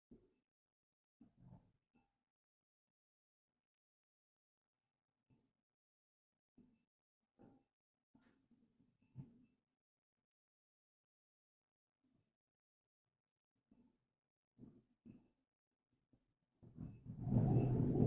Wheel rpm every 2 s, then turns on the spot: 0, 0, 0, 0, 0, 0, 0, 0, 0.
none